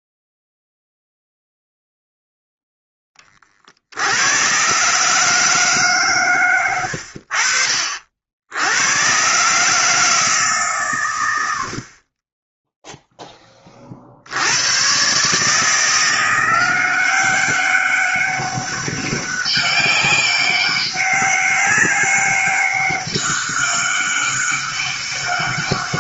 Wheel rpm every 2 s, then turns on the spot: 0, 0, 100, 140, 60, 150, 20, 60, 170, 200, 200, 200, 200.
none